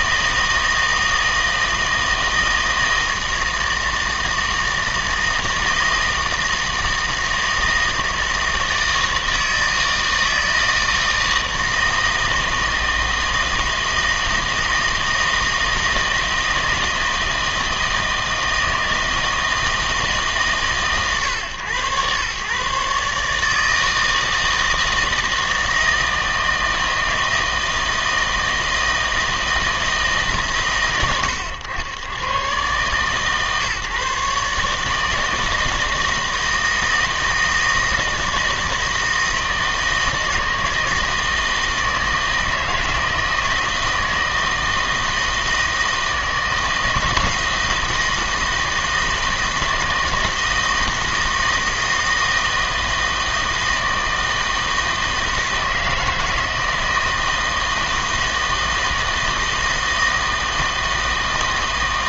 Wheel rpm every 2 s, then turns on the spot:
160, 160, 160, 160, 160, 160, 160, 160, 160, 160, 140, 140, 160, 160, 160, 130, 130, 150, 160, 160, 160, 160, 160, 160, 160, 160, 160, 160, 160, 160, 160.
none